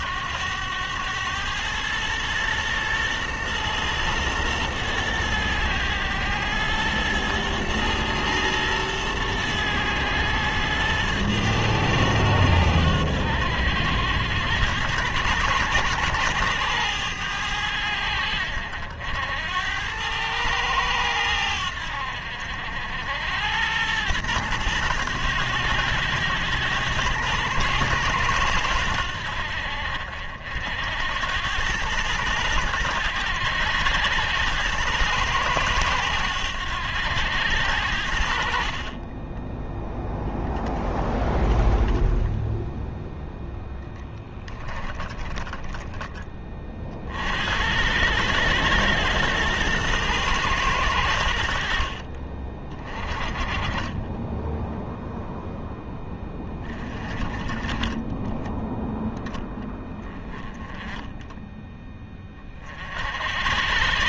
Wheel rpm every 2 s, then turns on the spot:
100, 120, 110, 110, 110, 110, 90, 100, 110, 70, 100, 70, 110, 110, 90, 70, 100, 100, 90, 40, 10, 0, 20, 40, 110, 100, 30, 0, 20, 10, 10, 50.
44-46